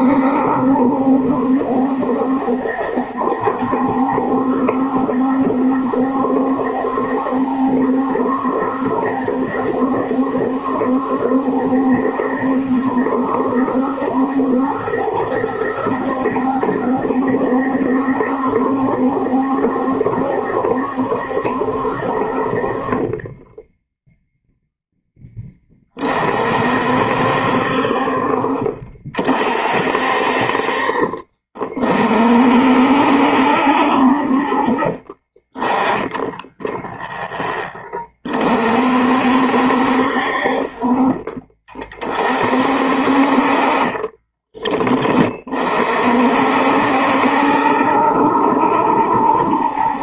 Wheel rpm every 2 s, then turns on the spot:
70, 70, 70, 70, 70, 70, 70, 70, 70, 70, 70, 40, 0, 50, 40, 50, 50, 40, 0, 40, 60, 50, 20, 60, 70.
30-32